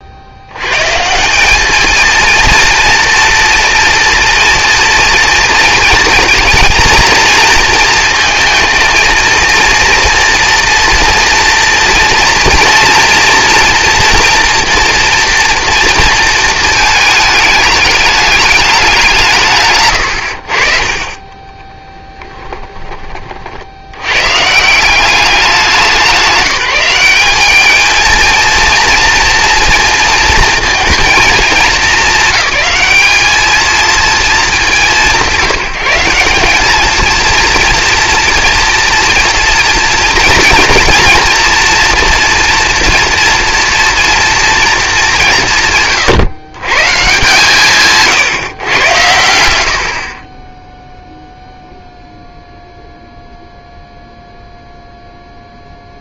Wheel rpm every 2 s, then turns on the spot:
120, 230, 230, 230, 230, 230, 230, 230, 230, 210, 40, 10, 150, 200, 230, 230, 220, 200, 210, 230, 230, 240, 220, 150, 120, 0, 0, 0.
none